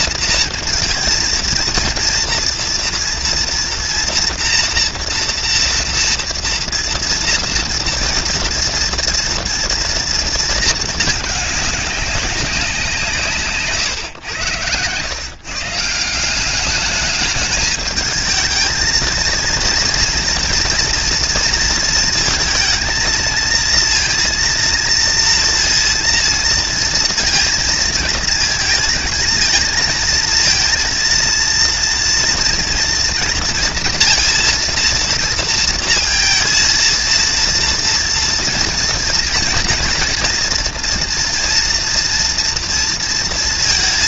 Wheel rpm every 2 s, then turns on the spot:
230, 230, 240, 230, 240, 220, 180, 110, 200, 220, 230, 230, 230, 230, 220, 230, 230, 230, 230, 230, 230, 230.
none